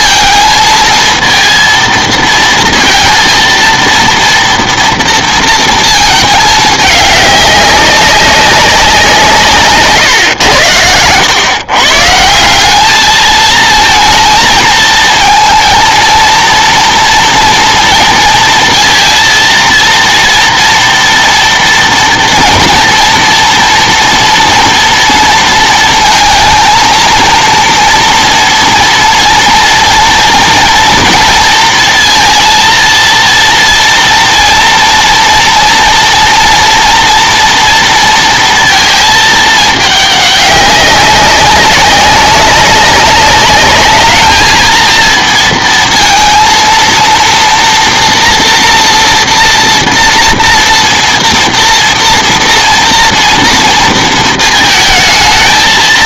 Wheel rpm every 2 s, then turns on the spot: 230, 230, 230, 210, 190, 100, 190, 220, 230, 230, 230, 230, 230, 220, 230, 230, 230, 230, 230, 230, 200, 190, 220, 230, 230, 230, 230, 220.
none